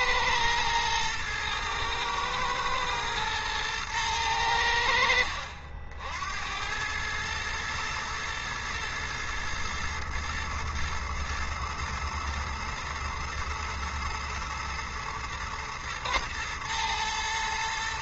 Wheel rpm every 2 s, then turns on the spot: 110, 110, 90, 100, 110, 110, 110, 120, 120.
none